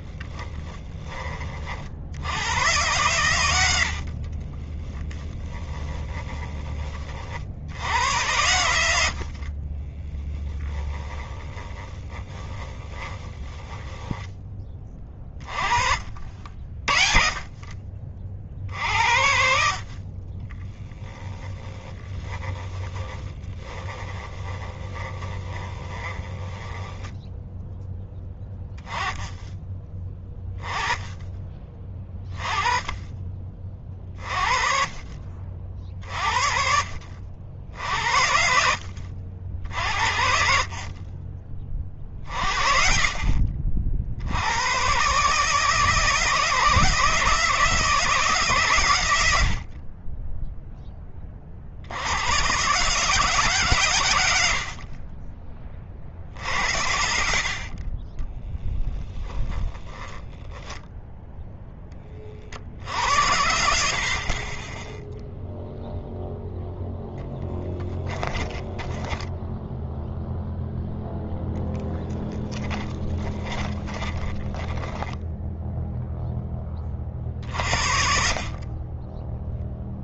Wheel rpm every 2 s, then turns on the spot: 20, 110, 20, 40, 70, 10, 10, 20, 40, 60, 10, 10, 20, 10, 20, 20, 30, 40, 60, 70, 40, 40, 130, 160, 110, 20, 150, 50, 70, 10, 0, 80, 10, 10, 10, 0, 30, 10, 40, 20.
4-6 8-14 22-28 54-56 58-60 68-70 72-76